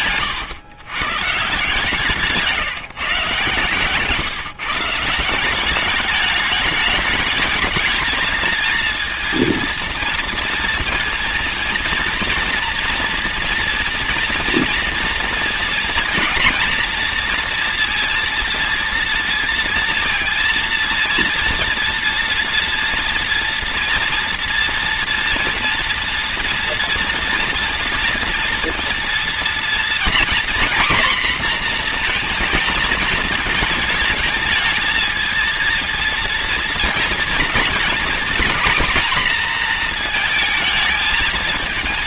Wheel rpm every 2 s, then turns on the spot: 130, 170, 150, 210, 220, 230, 230, 230, 230, 230, 230, 230, 230, 230, 230, 250, 230, 220, 230, 240, 220.
none